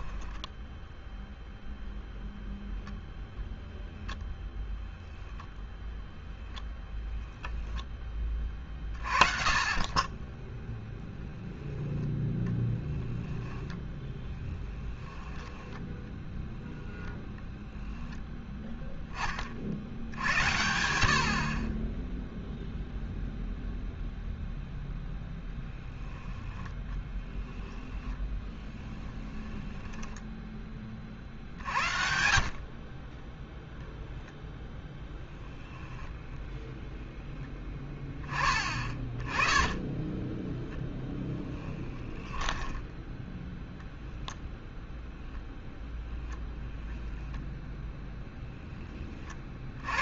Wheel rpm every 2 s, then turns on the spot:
10, 0, 0, 10, 30, 0, 10, 10, 0, 30, 70, 0, 10, 0, 10, 50, 0, 0, 0, 20, 10, 10, 0, 10, 30.
0-2 12-16 28-30 40-44 46-48